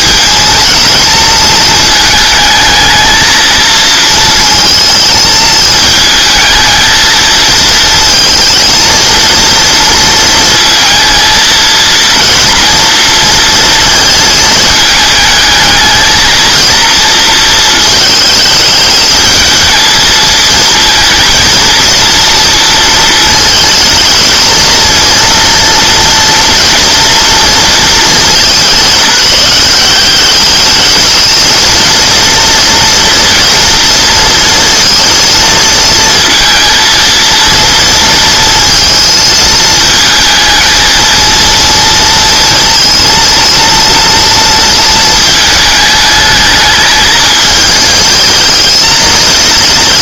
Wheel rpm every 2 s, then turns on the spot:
220, 220, 230, 220, 230, 220, 230, 220, 230, 220, 230, 230, 230, 230, 190, 210, 230, 230, 230, 230, 230, 230, 230, 210, 220.
none